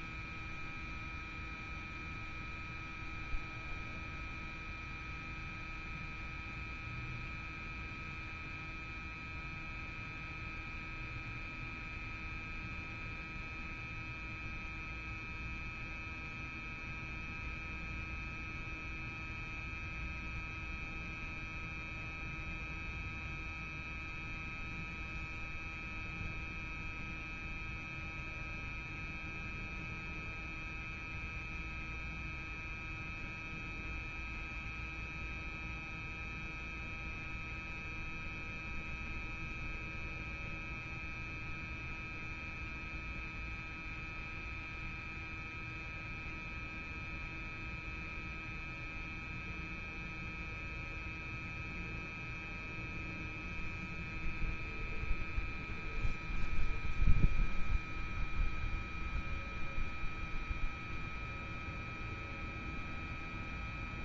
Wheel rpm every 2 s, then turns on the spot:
0, 0, 0, 0, 0, 0, 0, 0, 0, 0, 0, 0, 0, 0, 0, 0, 0, 0, 0, 0, 0, 0, 0, 0, 0, 0, 0, 0, 0, 0, 0, 0.
none